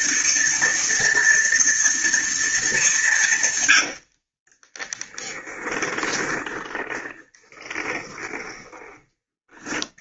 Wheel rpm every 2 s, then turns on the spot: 230, 210, 20, 10, 20.
4-8